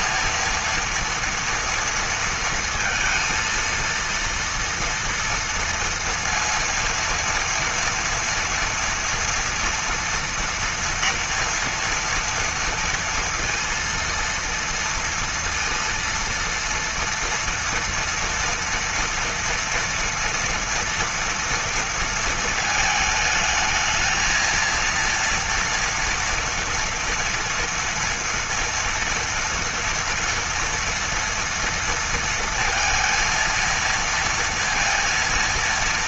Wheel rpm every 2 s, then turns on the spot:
230, 230, 230, 230, 230, 230, 230, 230, 230, 230, 230, 220, 230, 230, 230, 230, 230, 230.
none